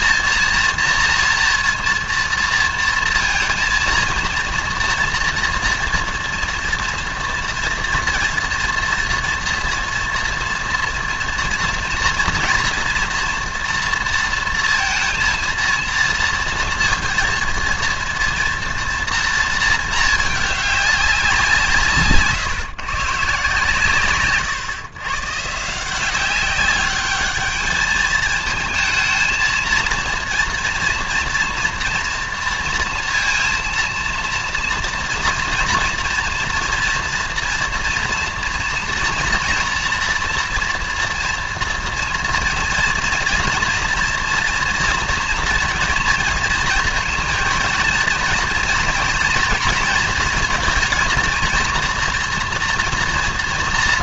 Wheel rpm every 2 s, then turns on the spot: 230, 230, 230, 230, 230, 230, 230, 230, 230, 230, 210, 140, 130, 200, 220, 230, 230, 230, 240, 240, 240, 230, 230, 230, 230, 230, 230.
none